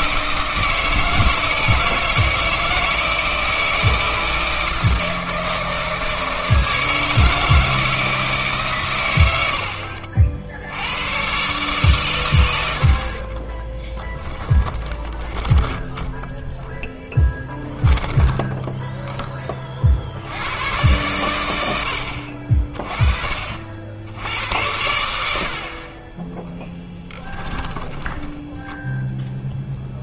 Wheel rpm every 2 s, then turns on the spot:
160, 160, 160, 160, 140, 70, 90, 10, 10, 10, 110, 40, 90, 10, 0.
14-16 18-20 26-28